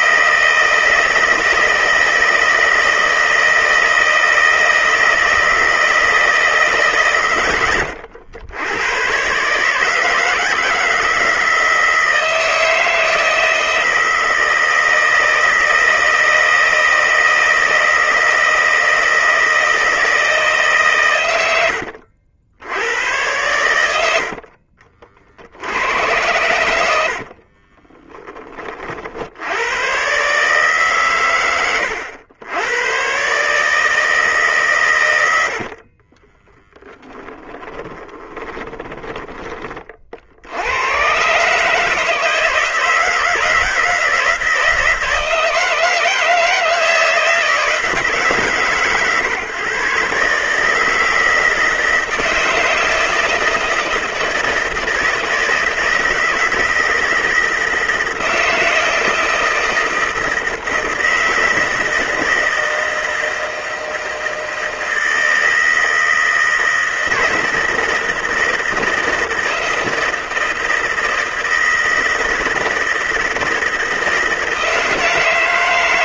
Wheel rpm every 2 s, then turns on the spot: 160, 160, 160, 150, 100, 160, 160, 160, 160, 160, 140, 90, 50, 90, 30, 140, 100, 130, 10, 10, 90, 160, 160, 160, 140, 150, 160, 160, 160, 160, 160, 160, 160, 160, 160, 160, 160, 160.
24-28 36-40